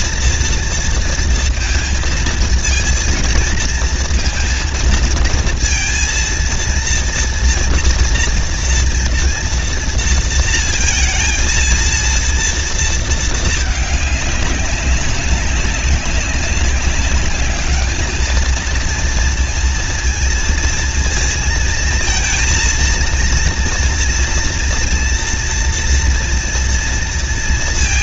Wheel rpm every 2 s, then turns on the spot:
230, 230, 230, 230, 230, 230, 230, 200, 190, 230, 230, 230, 230, 230.
none